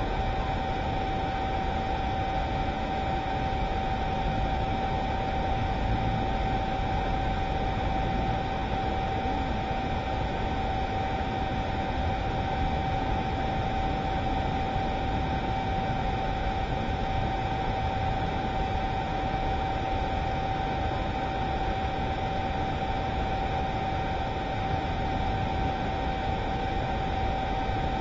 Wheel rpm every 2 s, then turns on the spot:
0, 0, 0, 0, 0, 0, 0, 0, 0, 0, 0, 0, 0, 0.
none